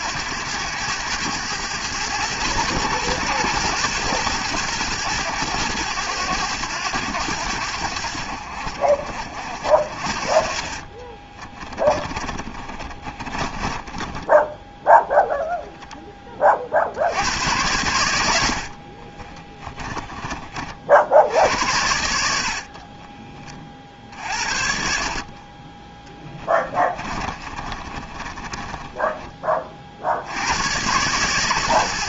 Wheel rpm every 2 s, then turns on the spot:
100, 110, 110, 100, 60, 40, 40, 10, 50, 60, 50, 40, 60, 20, 20, 110.
10-14 18-20 26-30